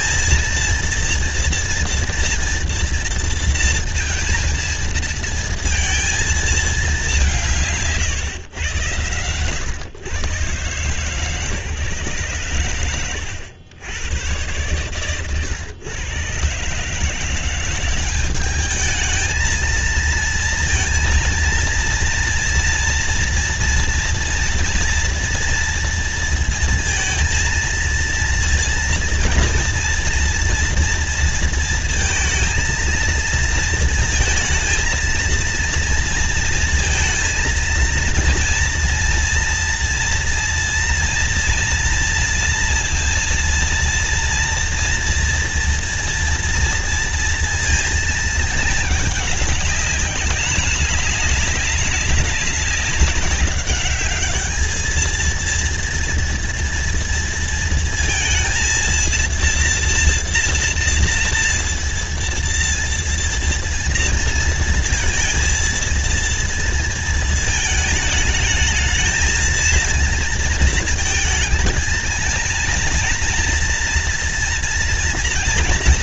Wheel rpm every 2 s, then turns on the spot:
230, 240, 230, 220, 110, 130, 120, 120, 130, 210, 230, 230, 240, 230, 230, 240, 220, 230, 230, 230, 230, 230, 230, 230, 220, 200, 200, 210, 230, 230, 230, 230, 230, 230, 220, 230, 230, 230.
none